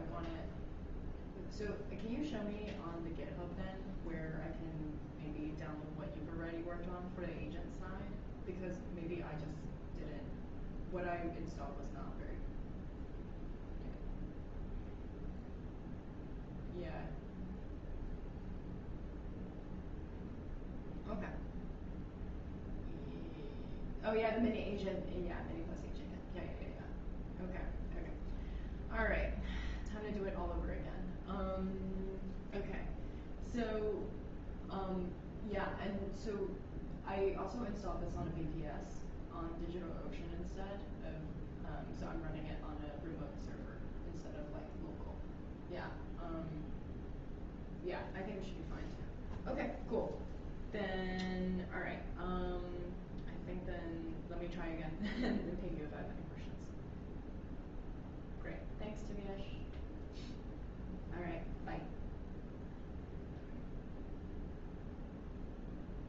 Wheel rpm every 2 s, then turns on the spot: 0, 0, 0, 0, 0, 0, 0, 0, 0, 0, 0, 0, 0, 0, 0, 0, 0, 0, 0, 0, 0, 0, 0, 0, 0, 0, 0, 0, 0, 0, 0, 0, 0.
none